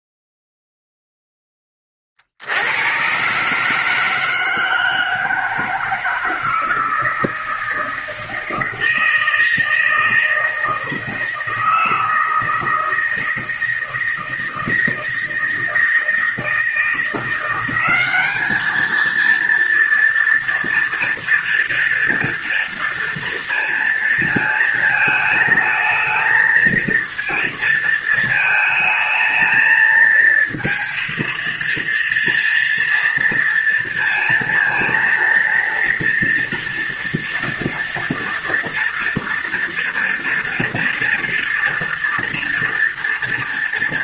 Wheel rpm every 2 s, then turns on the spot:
0, 60, 160, 160, 160, 160, 160, 160, 160, 210, 240, 230, 220, 230, 220, 230, 230, 230, 230, 230, 240, 240.
none